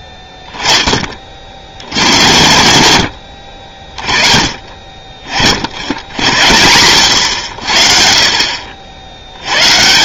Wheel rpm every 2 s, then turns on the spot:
10, 90, 30, 90, 40.
none